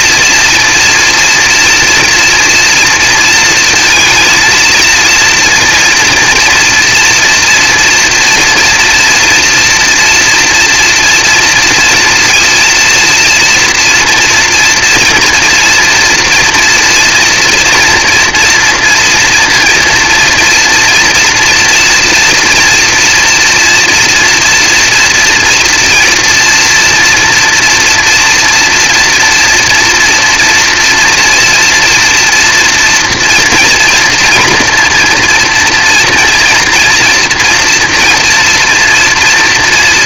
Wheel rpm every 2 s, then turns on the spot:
230, 230, 230, 230, 230, 230, 230, 230, 230, 230, 230, 240, 230, 230, 230, 230, 240, 230, 230, 230.
none